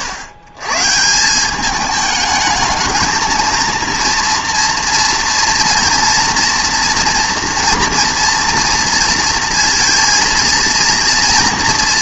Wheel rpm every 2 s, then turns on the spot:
120, 220, 230, 230, 230, 230.
none